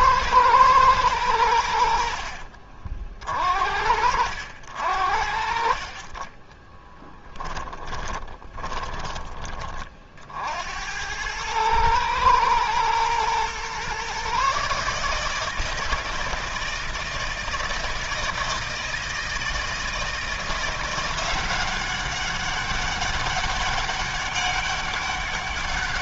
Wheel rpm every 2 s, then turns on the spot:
120, 50, 60, 20, 30, 60, 110, 140, 160, 160, 170, 200, 200.
2-4 6-10